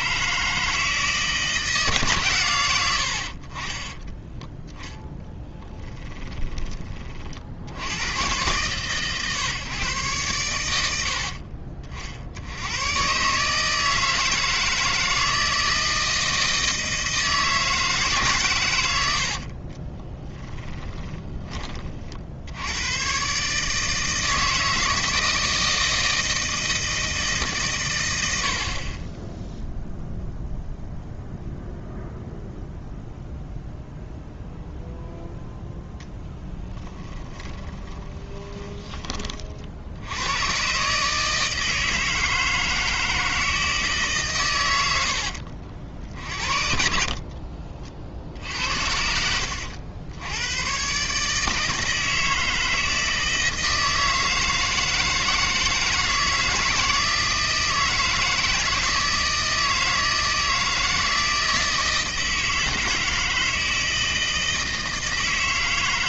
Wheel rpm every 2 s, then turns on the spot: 160, 90, 10, 30, 120, 90, 110, 160, 160, 100, 20, 90, 160, 160, 60, 0, 0, 0, 10, 20, 130, 160, 90, 50, 70, 120, 160, 160, 160, 160, 160, 160, 160.
20-22 36-38 46-50